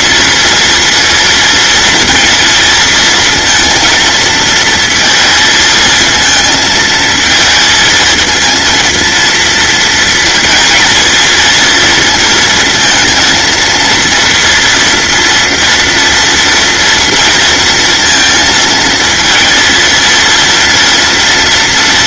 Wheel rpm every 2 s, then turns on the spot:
230, 230, 230, 220, 230, 220, 230, 230, 230, 230, 240.
none